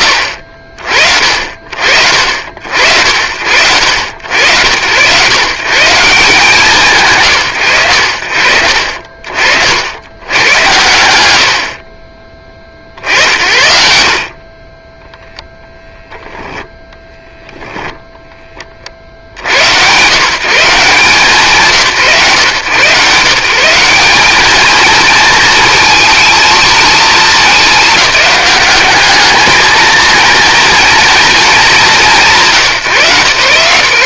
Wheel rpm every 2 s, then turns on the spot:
60, 40, 110, 160, 50, 130, 70, 30, 0, 30, 160, 140, 220, 220, 200, 230, 150.
none